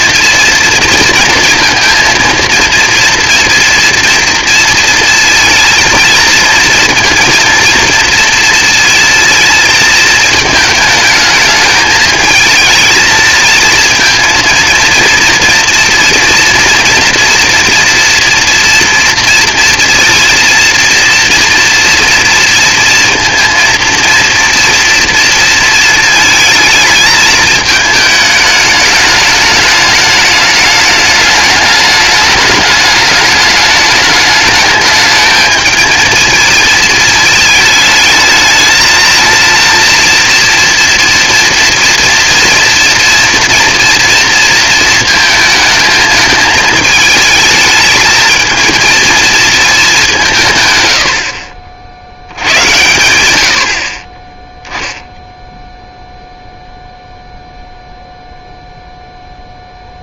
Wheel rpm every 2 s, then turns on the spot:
230, 230, 230, 230, 230, 220, 220, 230, 230, 230, 230, 230, 230, 220, 210, 210, 210, 210, 220, 220, 230, 230, 230, 220, 230, 120, 100, 0, 0, 0.
none